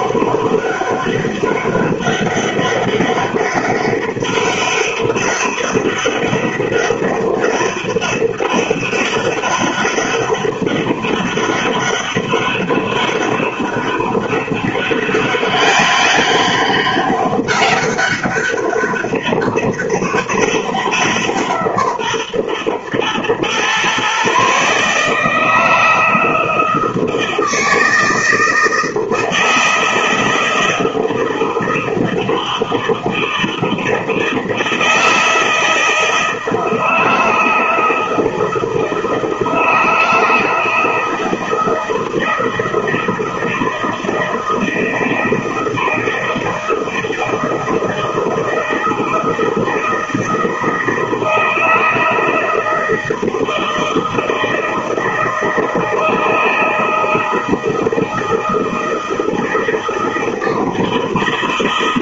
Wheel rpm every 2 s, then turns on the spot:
200, 200, 200, 200, 200, 200, 200, 200, 200, 200, 180, 120, 150, 160, 160, 160, 160, 160, 160, 160, 160, 160, 160, 160, 160, 160, 160, 160, 160, 160, 160.
none